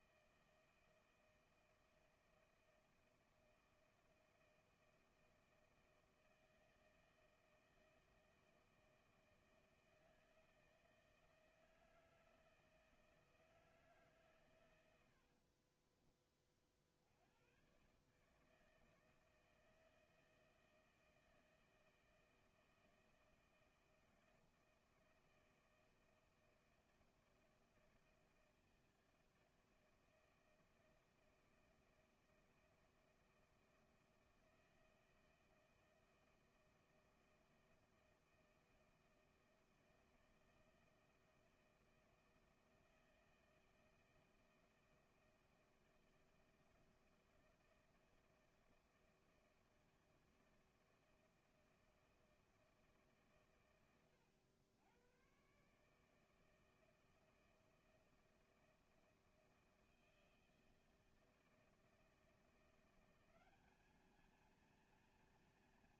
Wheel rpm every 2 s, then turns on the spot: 160, 160, 160, 160, 160, 160, 160, 90, 60, 160, 160, 160, 160, 160, 160, 160, 160, 160, 160, 160, 160, 160, 160, 160, 160, 160, 160, 100, 160, 160, 160, 160, 230.
none